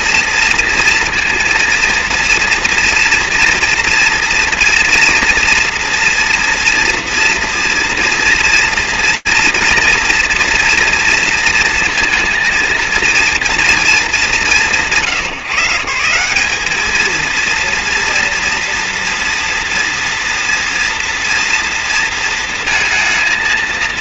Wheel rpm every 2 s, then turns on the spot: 230, 230, 240, 230, 230, 240, 230, 170, 200, 230, 230, 230.
none